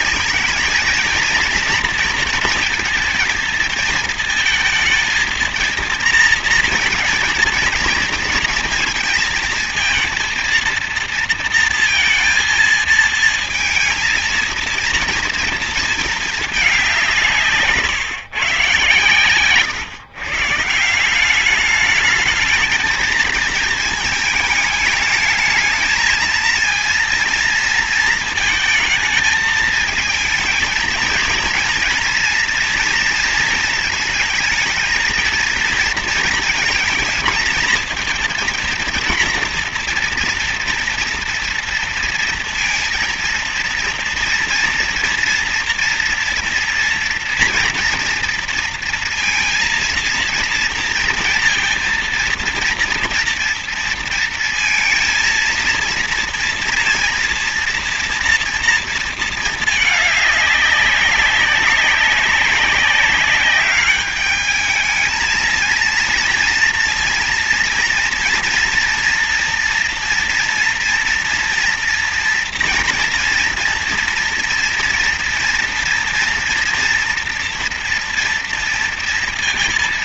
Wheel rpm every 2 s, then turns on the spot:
230, 230, 230, 230, 230, 230, 230, 230, 210, 140, 150, 210, 210, 230, 220, 220, 230, 220, 230, 240, 230, 230, 230, 230, 230, 230, 230, 230, 230, 230, 200, 190, 210, 230, 230, 230, 230, 230, 230, 230.
none